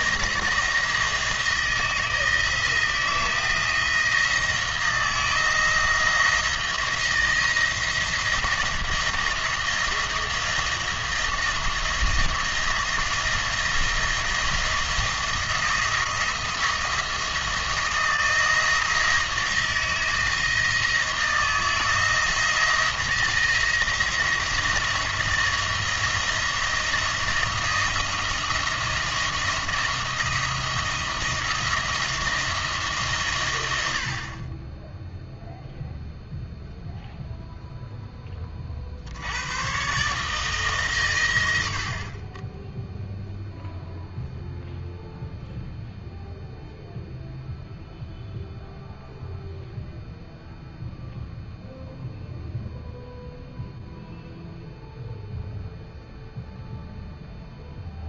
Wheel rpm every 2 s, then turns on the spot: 160, 160, 170, 170, 170, 160, 170, 170, 170, 160, 160, 170, 170, 170, 170, 170, 150, 10, 0, 60, 140, 0, 0, 0, 0, 0, 0, 0, 0.
none